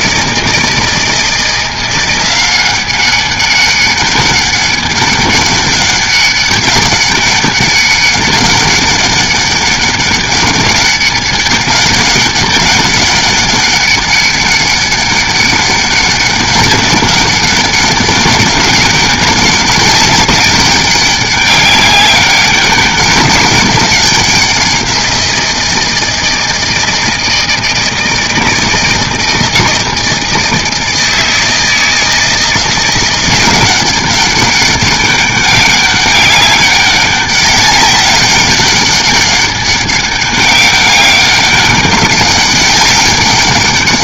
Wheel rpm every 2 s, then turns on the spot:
160, 190, 200, 200, 200, 200, 200, 200, 200, 200, 200, 190, 180, 160, 160, 160, 170, 200, 200, 200, 200, 200.
none